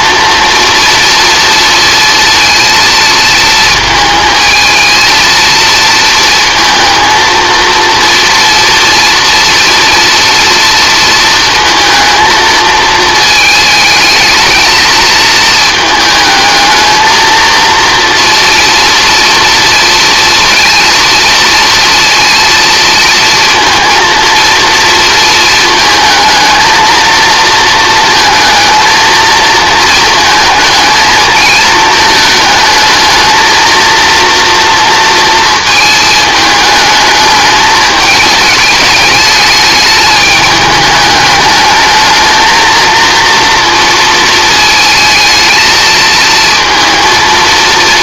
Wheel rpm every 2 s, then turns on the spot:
230, 230, 230, 230, 230, 230, 220, 220, 220, 230, 230, 230, 220, 230, 230, 220, 220, 230, 220, 210, 210, 230, 220, 230.
none